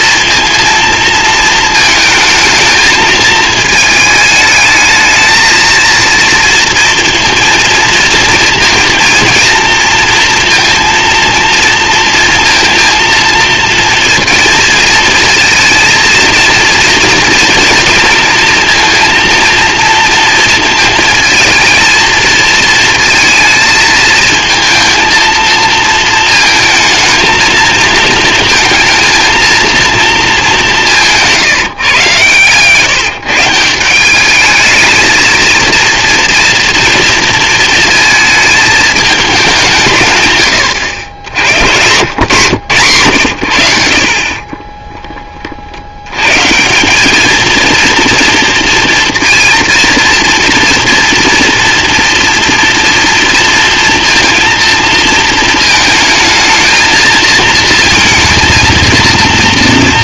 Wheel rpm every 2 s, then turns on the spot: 230, 220, 220, 230, 230, 230, 230, 230, 230, 230, 230, 220, 230, 220, 230, 200, 130, 220, 230, 220, 100, 130, 20, 180, 230, 230, 230, 230, 220, 230.
44-46